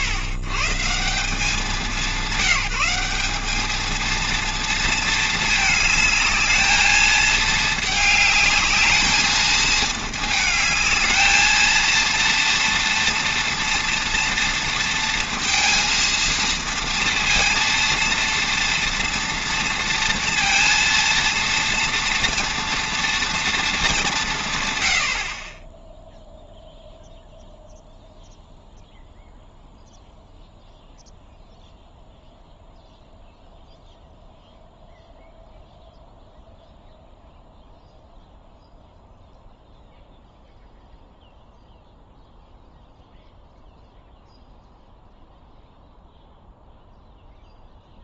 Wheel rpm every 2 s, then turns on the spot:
130, 180, 230, 220, 220, 220, 230, 230, 230, 230, 230, 240, 120, 0, 0, 0, 0, 0, 0, 0, 0, 0, 0, 0.
none